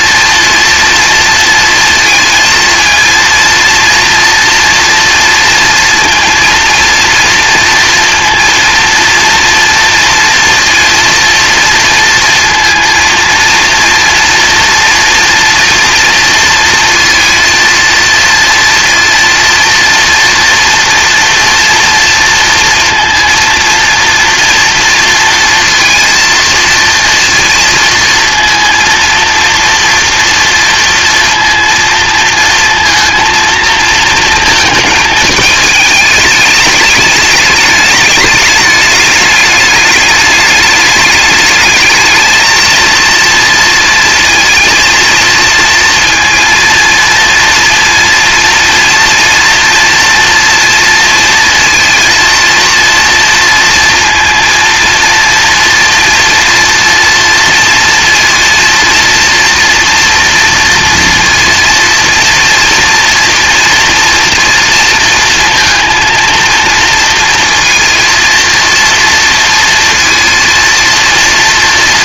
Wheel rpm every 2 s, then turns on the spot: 230, 230, 230, 230, 230, 240, 230, 230, 230, 230, 230, 230, 230, 230, 230, 240, 230, 220, 210, 210, 210, 230, 230, 230, 240, 230, 230, 230, 240, 230, 230, 230, 230, 230, 230, 230.
none